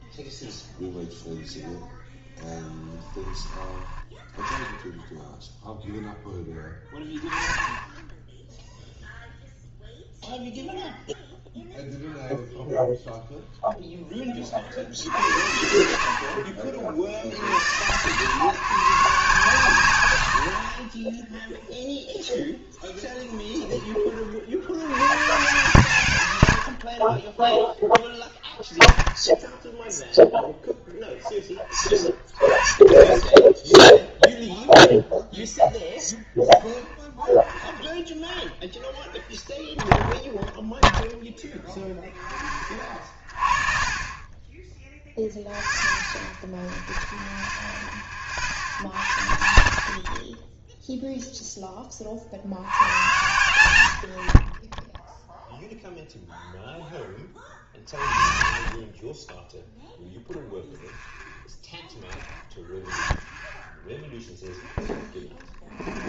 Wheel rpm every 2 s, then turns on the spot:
0, 10, 10, 10, 0, 0, 0, 60, 50, 140, 50, 10, 60, 100, 0, 0, 20, 0, 0, 0, 0, 20, 10, 0, 30, 10, 80, 20, 0, 40, 0, 10, 0.
2-4